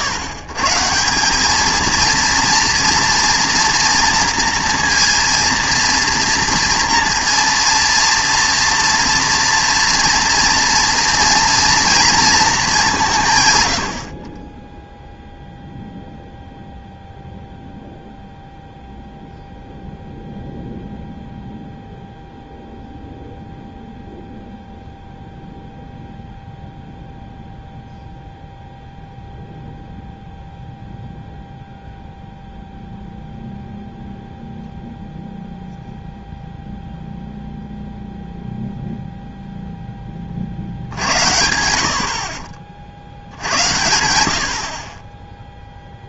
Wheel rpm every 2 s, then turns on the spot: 110, 230, 240, 230, 230, 230, 200, 10, 0, 0, 0, 0, 0, 0, 0, 0, 0, 0, 0, 0, 60, 50, 50.
none